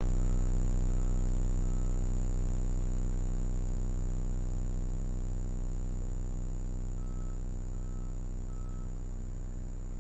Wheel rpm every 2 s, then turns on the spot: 0, 0, 0, 0, 0.
none